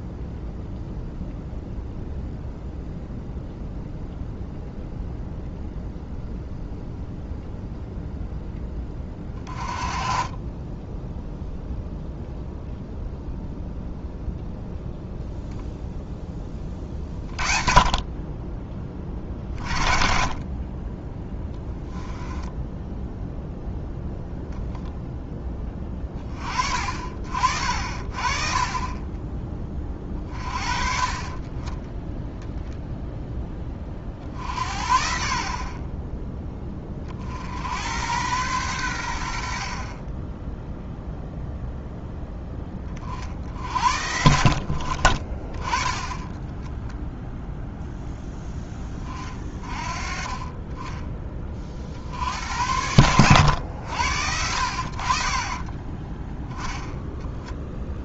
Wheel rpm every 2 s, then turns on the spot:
0, 0, 0, 0, 10, 10, 0, 0, 30, 30, 20, 10, 10, 40, 30, 40, 0, 50, 30, 100, 0, 30, 30, 10, 20, 20, 90, 60, 10.
8-12